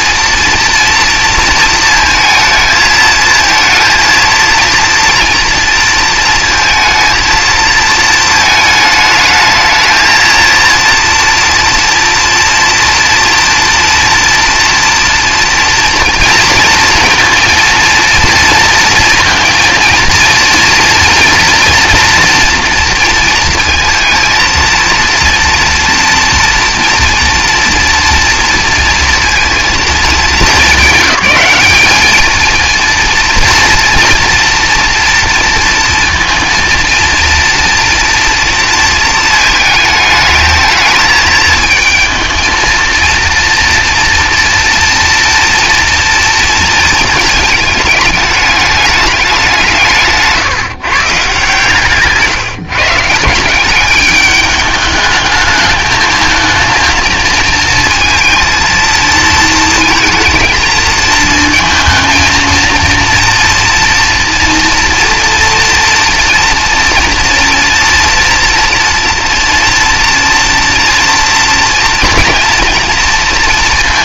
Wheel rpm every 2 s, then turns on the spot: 230, 220, 230, 230, 220, 230, 230, 230, 230, 230, 230, 230, 220, 230, 230, 200, 230, 230, 230, 230, 220, 220, 230, 230, 210, 140, 150, 210, 230, 220, 220, 230, 230, 230, 230, 240, 230.
none